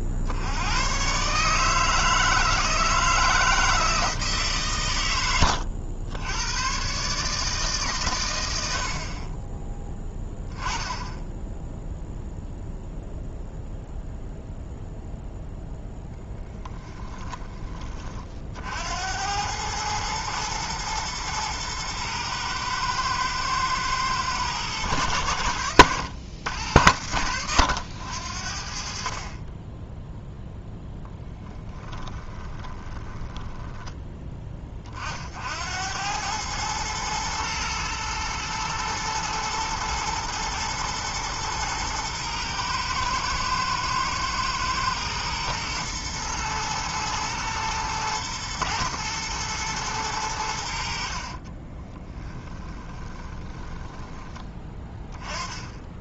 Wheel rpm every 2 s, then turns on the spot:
60, 160, 130, 110, 80, 10, 0, 0, 10, 80, 120, 120, 100, 80, 40, 0, 20, 40, 110, 120, 120, 110, 110, 120, 110, 60, 20, 10.
32-34 52-54